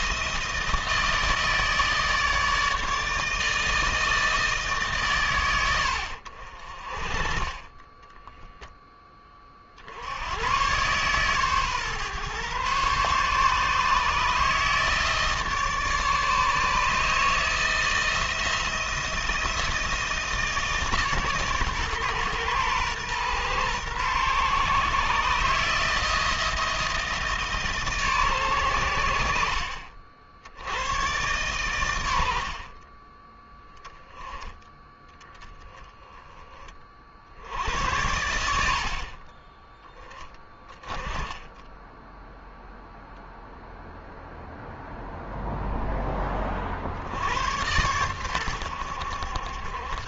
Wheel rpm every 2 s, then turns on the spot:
160, 160, 140, 40, 20, 130, 140, 150, 150, 170, 140, 120, 150, 160, 90, 100, 20, 10, 60, 40, 20, 0, 0, 70, 80.
none